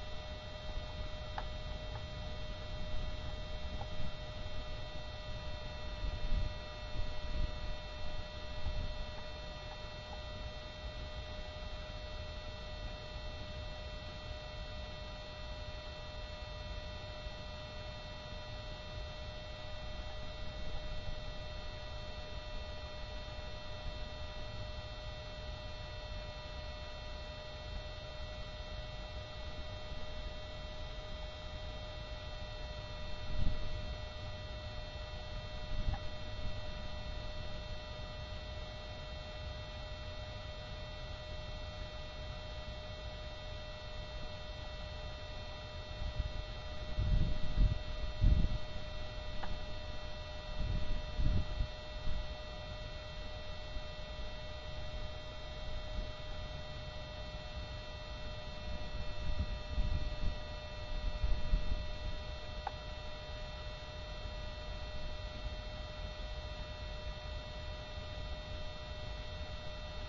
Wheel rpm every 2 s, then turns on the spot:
0, 0, 0, 0, 0, 0, 0, 0, 0, 0, 0, 0, 0, 0, 0, 0, 0, 0, 0, 0, 0, 0, 0, 0, 0, 0, 0, 0, 0, 0, 0, 0, 0, 0, 0.
none